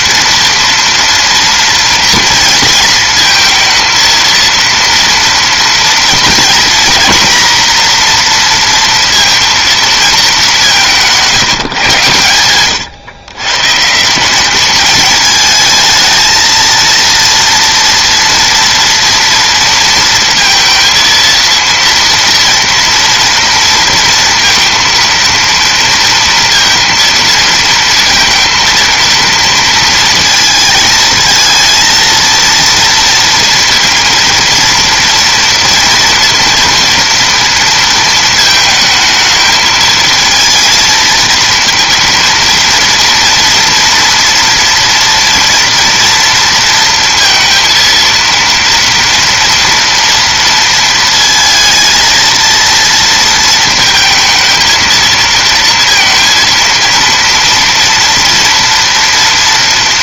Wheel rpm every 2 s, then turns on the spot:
240, 230, 230, 240, 230, 190, 110, 210, 230, 230, 230, 230, 230, 230, 230, 220, 230, 230, 230, 220, 230, 230, 230, 230, 230, 230, 230, 230, 230, 230.
none